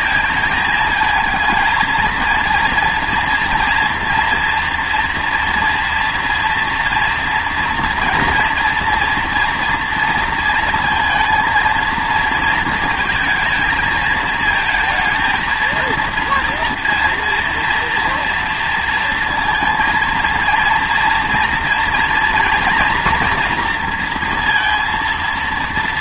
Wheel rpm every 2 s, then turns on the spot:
220, 230, 230, 230, 230, 230, 230, 220, 230, 230, 230, 230, 230.
none